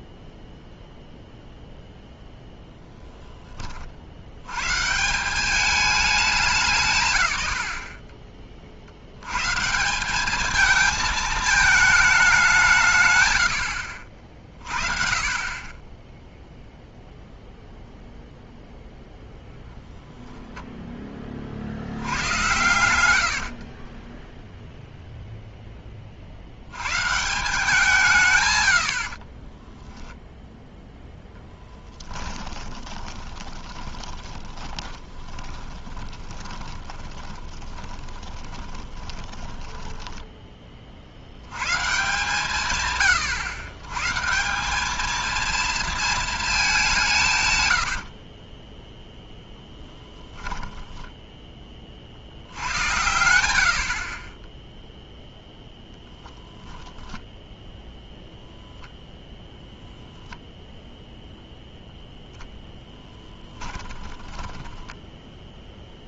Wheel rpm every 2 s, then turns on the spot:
0, 80, 200, 20, 180, 210, 50, 10, 0, 0, 80, 40, 20, 160, 0, 10, 20, 20, 20, 10, 110, 130, 230, 120, 0, 10, 80, 0, 0, 0, 0, 10, 10.
22-24 30-40 46-48 62-66